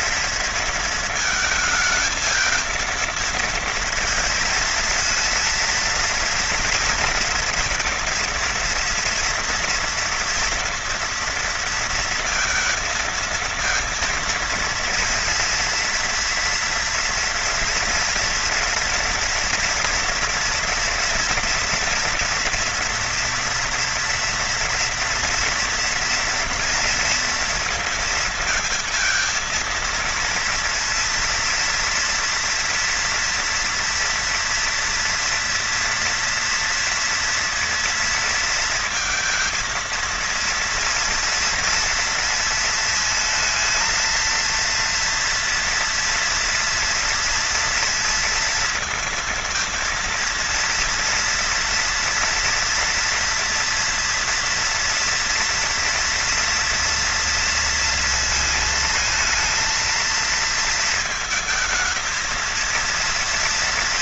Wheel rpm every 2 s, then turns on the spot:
230, 230, 220, 230, 230, 230, 230, 230, 230, 230, 230, 230, 230, 230, 220, 230, 230, 230, 230, 230, 230, 220, 230, 230, 230, 230, 230, 240, 230, 230, 220, 230.
none